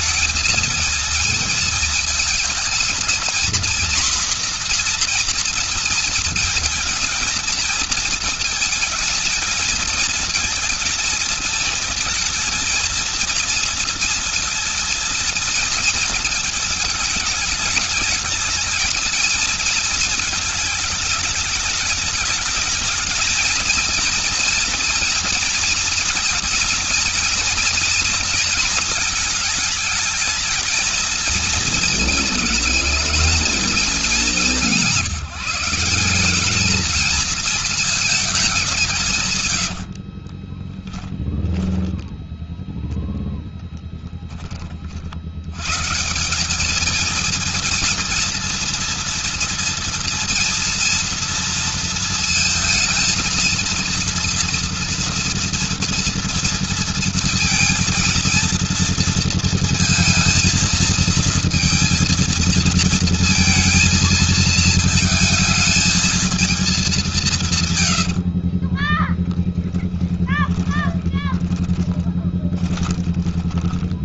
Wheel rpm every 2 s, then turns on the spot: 220, 230, 240, 220, 220, 230, 230, 230, 220, 220, 220, 220, 230, 240, 230, 220, 220, 180, 200, 200, 30, 0, 20, 190, 230, 230, 220, 230, 230, 230, 230, 230, 220, 220, 50, 20, 20.
40-42 68-74